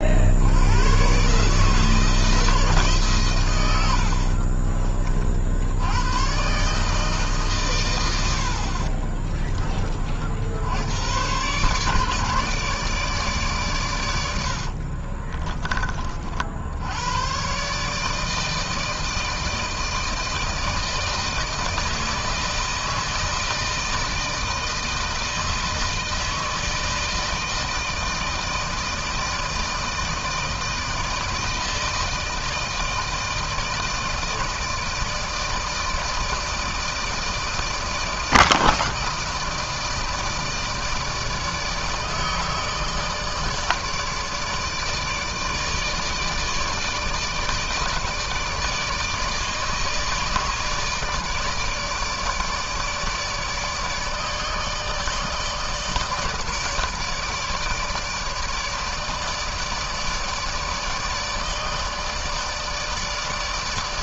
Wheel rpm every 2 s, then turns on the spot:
80, 160, 50, 140, 60, 70, 150, 80, 70, 160, 160, 160, 160, 160, 160, 160, 160, 160, 160, 160, 160, 150, 150, 160, 160, 150, 150, 150, 160, 160, 150, 160.
4-6 8-10 14-16